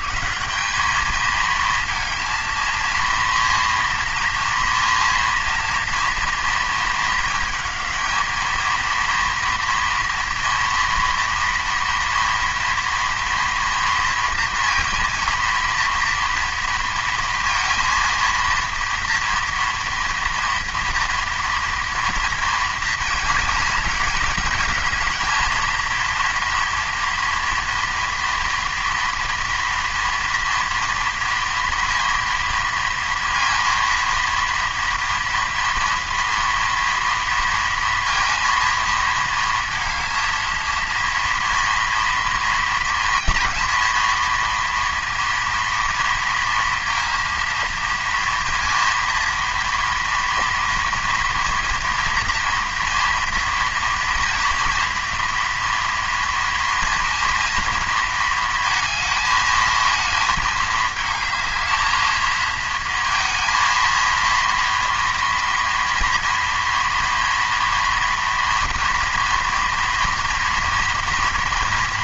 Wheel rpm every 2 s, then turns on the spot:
170, 230, 230, 230, 230, 230, 230, 230, 230, 230, 240, 230, 220, 230, 230, 230, 230, 230, 230, 230, 230, 230, 230, 230, 230, 230, 230, 240, 230, 230, 220, 230, 230, 230, 230, 230.
none